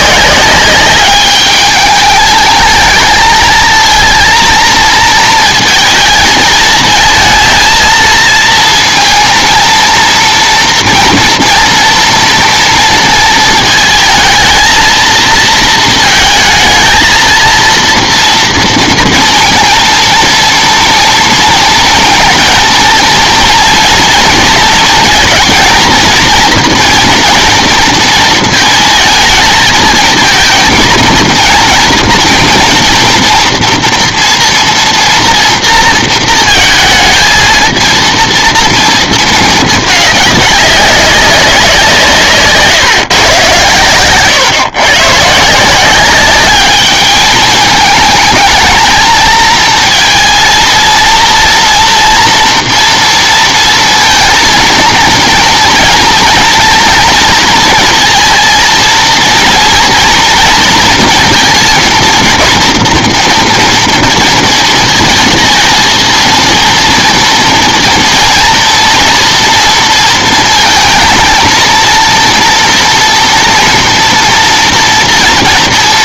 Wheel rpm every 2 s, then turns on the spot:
190, 220, 230, 220, 230, 240, 230, 220, 220, 230, 230, 230, 230, 230, 220, 230, 230, 240, 220, 230, 200, 150, 130, 210, 220, 230, 240, 230, 230, 230, 230, 240, 230, 230, 230, 230, 230, 230.
none